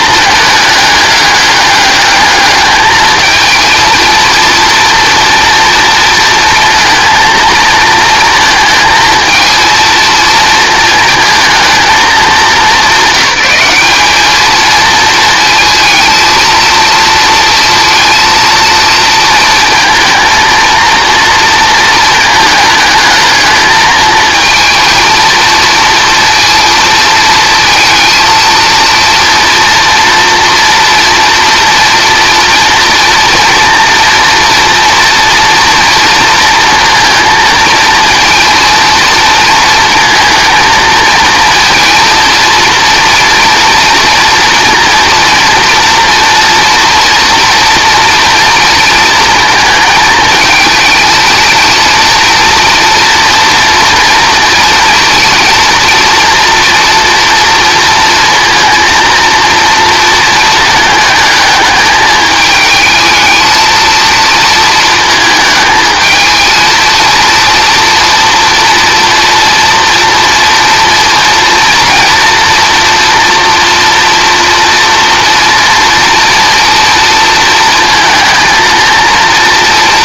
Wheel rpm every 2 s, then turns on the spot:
210, 210, 230, 230, 220, 230, 190, 220, 230, 230, 230, 220, 230, 230, 230, 230, 230, 230, 230, 230, 230, 230, 230, 240, 230, 220, 230, 220, 230, 240, 220, 220, 230, 220, 230, 230, 230, 230, 230, 230.
none